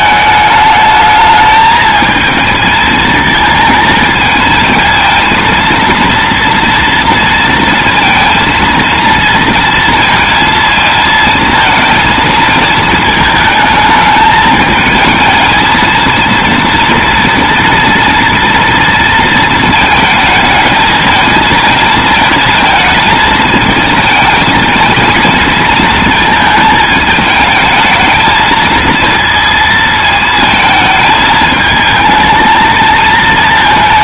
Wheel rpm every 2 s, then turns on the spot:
220, 220, 230, 230, 230, 220, 220, 220, 230, 220, 220, 220, 230, 220, 230, 220, 220.
none